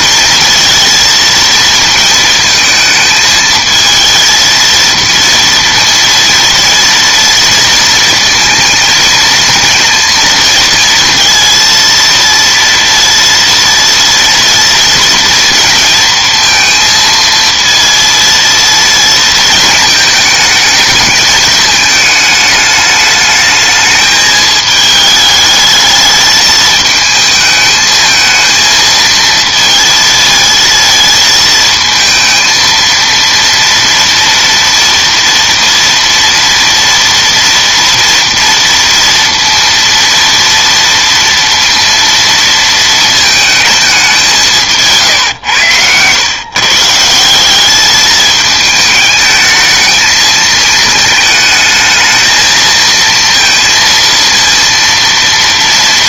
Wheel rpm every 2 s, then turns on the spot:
230, 220, 230, 230, 230, 230, 230, 230, 230, 230, 210, 210, 210, 220, 230, 220, 230, 230, 230, 230, 230, 220, 150, 150, 220, 220, 230, 230.
none